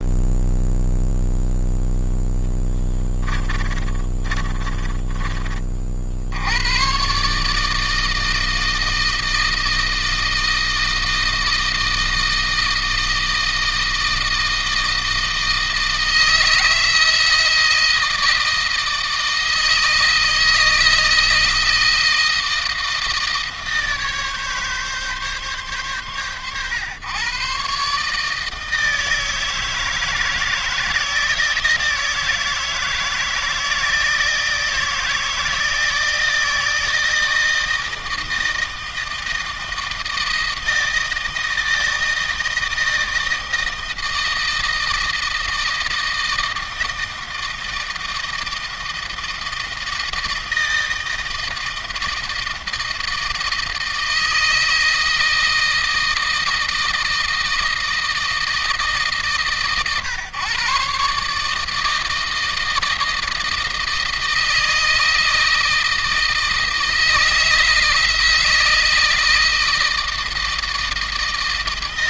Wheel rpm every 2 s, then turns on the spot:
0, 10, 20, 90, 160, 160, 160, 160, 160, 160, 160, 170, 140, 110, 160, 160, 160, 160, 160, 160, 160, 160, 160, 160, 160, 160, 160, 160, 160, 160, 130, 160, 160, 160, 160, 160.
2-6